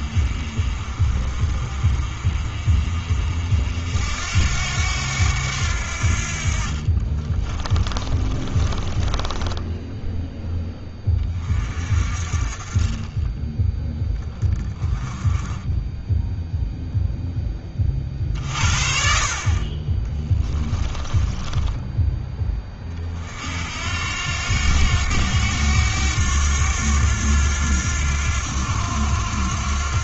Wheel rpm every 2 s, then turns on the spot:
50, 50, 90, 40, 20, 10, 30, 10, 0, 40, 20, 30, 90, 90, 90.
8-10 20-22